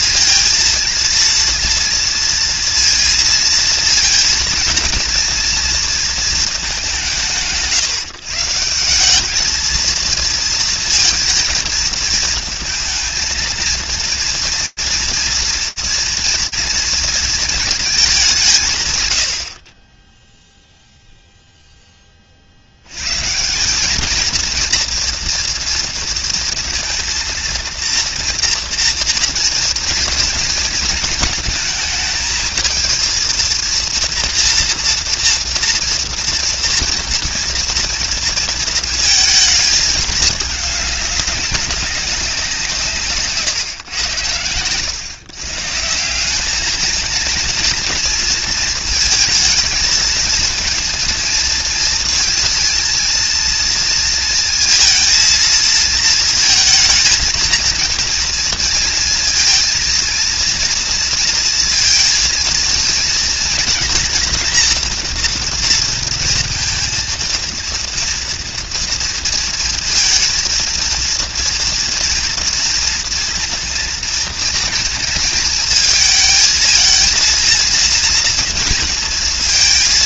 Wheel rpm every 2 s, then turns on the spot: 230, 230, 230, 180, 170, 220, 230, 230, 230, 130, 0, 130, 240, 230, 230, 220, 230, 240, 240, 230, 200, 150, 140, 230, 220, 230, 230, 230, 220, 230, 230, 230, 230, 230, 230, 230, 230, 230, 230, 230.
42-44